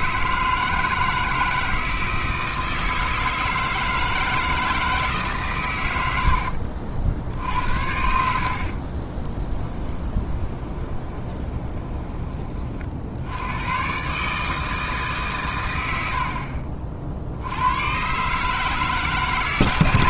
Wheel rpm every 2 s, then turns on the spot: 160, 160, 160, 60, 40, 20, 40, 150, 40, 150.
8-12